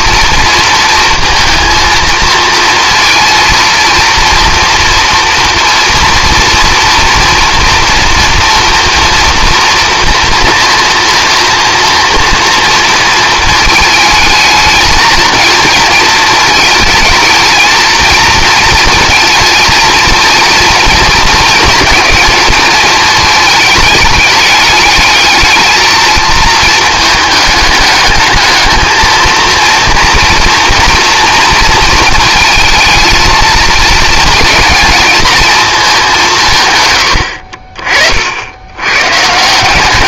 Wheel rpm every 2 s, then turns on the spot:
230, 230, 230, 230, 230, 230, 230, 220, 220, 220, 230, 220, 210, 220, 220, 230, 230, 230, 120, 110.
none